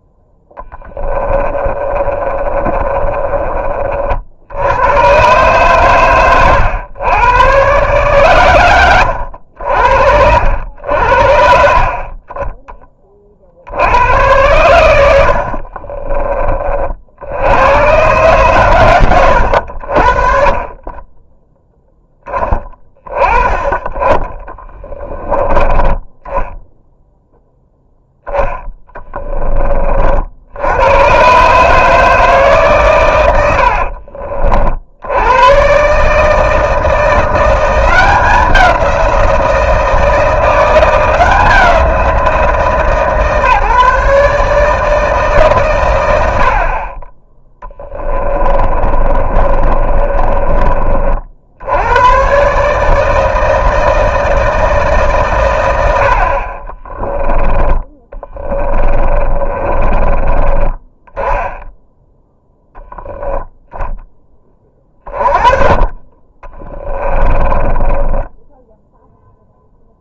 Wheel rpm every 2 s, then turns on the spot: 10, 30, 90, 110, 120, 80, 20, 100, 50, 120, 20, 20, 10, 0, 10, 100, 140, 60, 170, 180, 170, 150, 160, 40, 30, 40, 150, 150, 30, 30, 30, 0, 30, 20, 0.
0-4 28-30 48-50 56-60 66-68